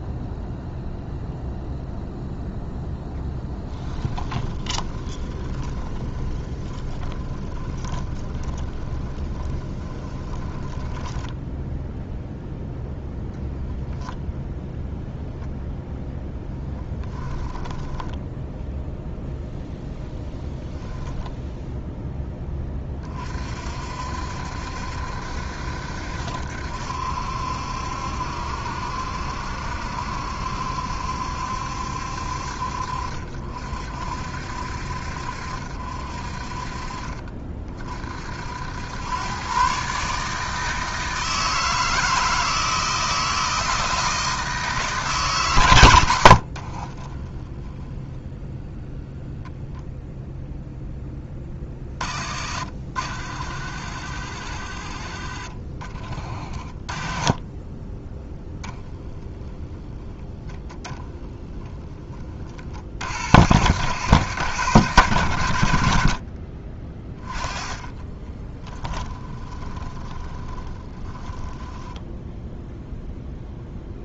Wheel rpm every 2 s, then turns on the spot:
0, 0, 20, 20, 20, 20, 0, 0, 10, 0, 10, 20, 70, 70, 70, 70, 60, 60, 40, 90, 160, 160, 160, 40, 0, 0, 50, 40, 30, 0, 0, 40, 110, 30, 20, 20, 0.
4-12 16-18 46-48 68-72